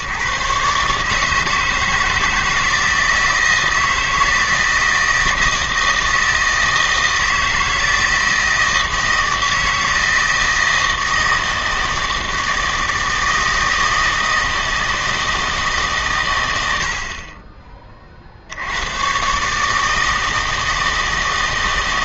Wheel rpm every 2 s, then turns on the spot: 140, 160, 160, 160, 160, 160, 160, 160, 90, 80, 160.
none